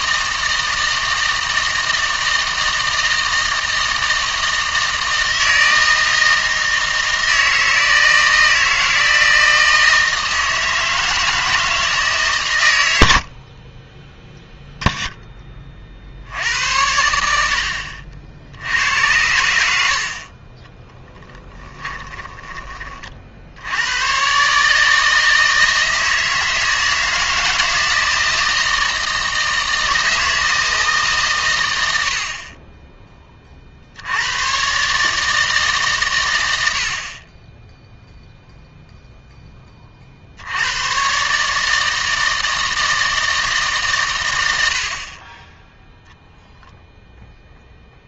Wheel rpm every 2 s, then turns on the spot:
160, 160, 160, 160, 160, 160, 110, 0, 80, 80, 20, 30, 150, 160, 160, 160, 30, 130, 80, 0, 100, 160, 80, 0.
20-22